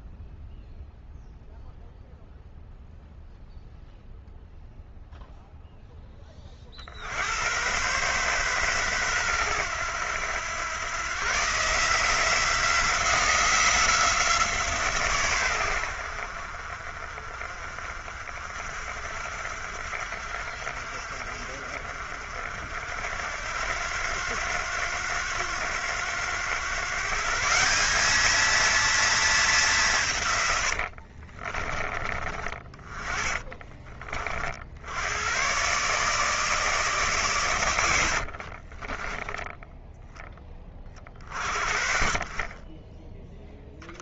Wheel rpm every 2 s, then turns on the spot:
0, 0, 0, 50, 120, 110, 180, 150, 50, 50, 60, 60, 90, 120, 220, 90, 30, 60, 150, 30, 30, 20.
30-34 38-40 42-44